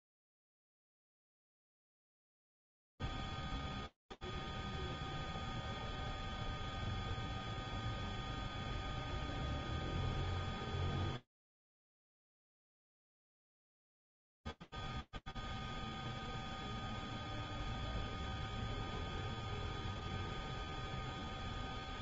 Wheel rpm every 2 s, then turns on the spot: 0, 0, 0, 0, 0, 0, 0, 0, 0, 0, 0.
none